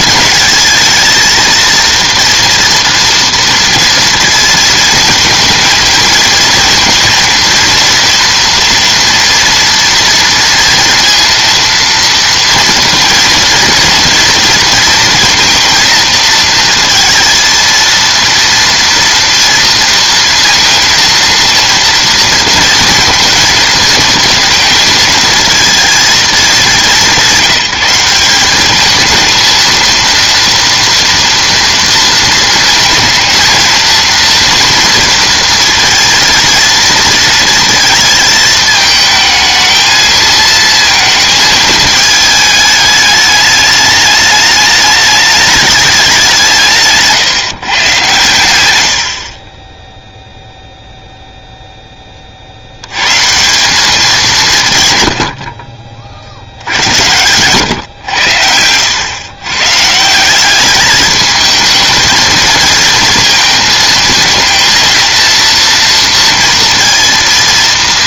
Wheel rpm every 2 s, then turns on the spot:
220, 230, 230, 230, 230, 230, 230, 230, 230, 230, 230, 230, 230, 190, 190, 230, 230, 230, 230, 220, 230, 220, 210, 170, 100, 0, 60, 150, 80, 90, 200, 230, 230, 230.
none